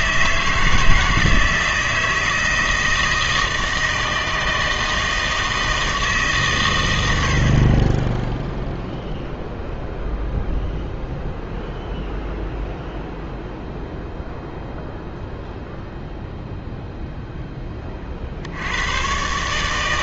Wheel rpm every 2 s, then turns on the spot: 160, 160, 160, 120, 0, 0, 0, 0, 0, 90.
none